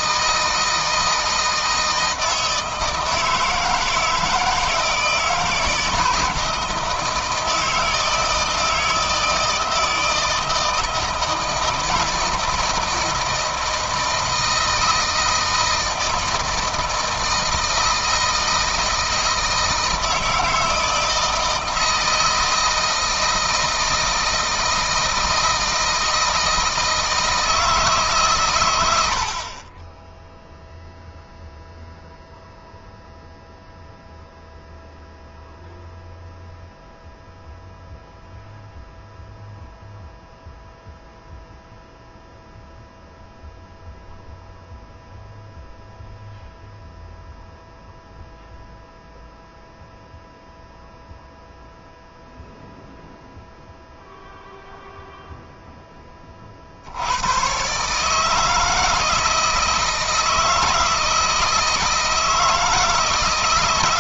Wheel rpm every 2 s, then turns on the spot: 160, 160, 160, 160, 160, 160, 160, 160, 160, 160, 160, 160, 160, 160, 110, 0, 0, 0, 0, 0, 0, 0, 0, 0, 0, 0, 0, 0, 60, 160, 160, 160.
none